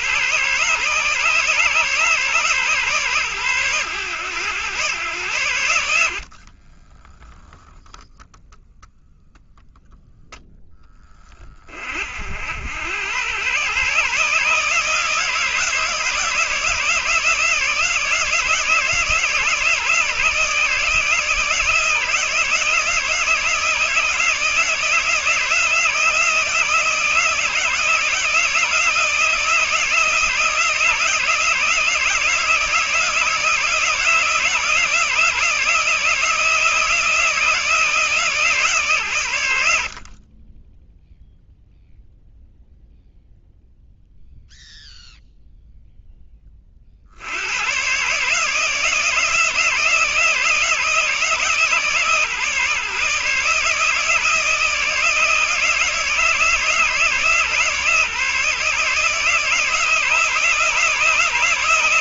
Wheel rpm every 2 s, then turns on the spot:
140, 130, 110, 20, 0, 10, 90, 160, 160, 160, 150, 160, 160, 160, 160, 160, 160, 160, 160, 130, 0, 0, 0, 40, 150, 160, 150, 160, 150, 150, 150.
6-8